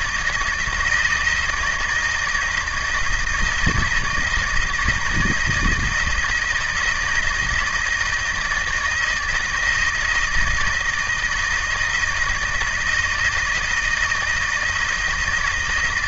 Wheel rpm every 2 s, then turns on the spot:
160, 160, 160, 170, 160, 160, 160, 160.
none